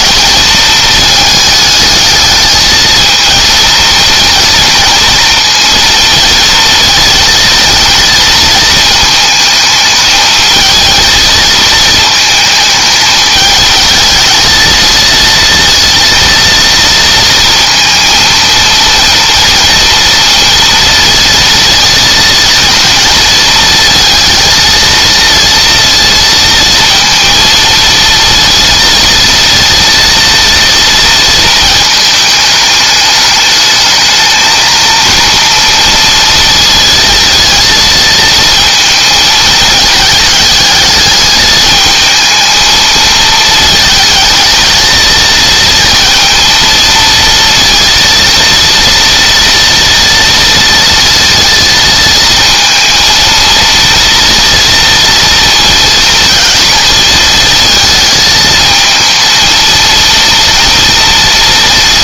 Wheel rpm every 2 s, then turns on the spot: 220, 220, 230, 230, 220, 220, 210, 220, 230, 230, 230, 230, 230, 230, 230, 230, 210, 220, 230, 230, 210, 220, 220, 230, 230, 230, 230, 230, 230, 220, 230.
none